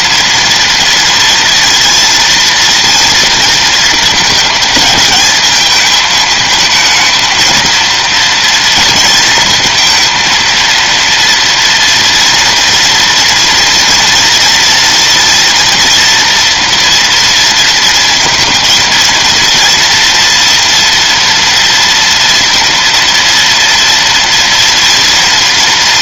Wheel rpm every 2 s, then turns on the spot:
230, 230, 210, 220, 230, 230, 230, 230, 240, 230, 230, 230, 230.
none